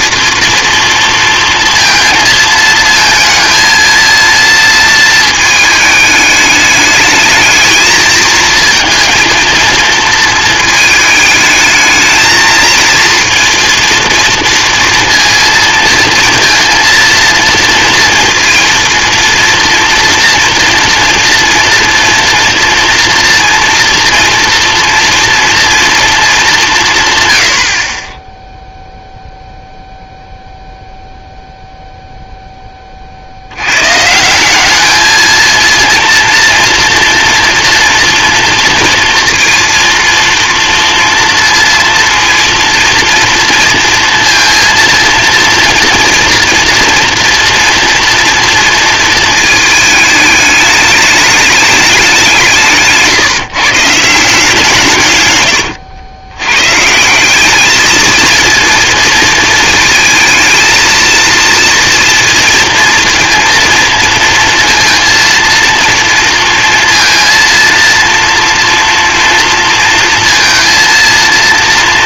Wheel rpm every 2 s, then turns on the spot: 230, 220, 230, 210, 230, 220, 220, 230, 230, 230, 230, 230, 230, 180, 0, 0, 10, 190, 240, 230, 230, 230, 230, 240, 230, 210, 170, 160, 120, 220, 220, 230, 230, 230, 230, 230.
none